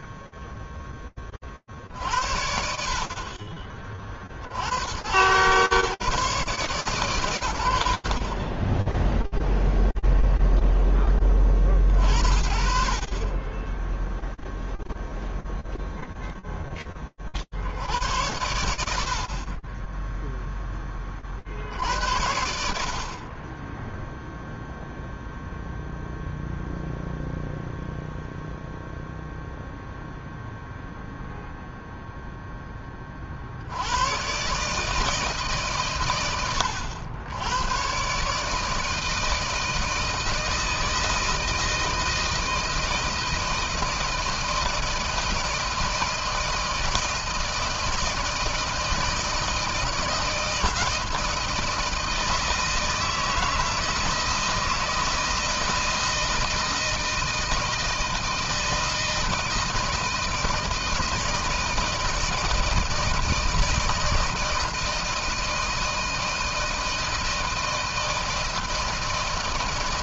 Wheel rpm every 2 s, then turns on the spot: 10, 50, 110, 130, 0, 20, 30, 0, 40, 60, 30, 40, 0, 0, 0, 0, 10, 140, 90, 150, 160, 160, 160, 160, 160, 160, 160, 160, 160, 160, 160, 160, 160, 160, 160.
none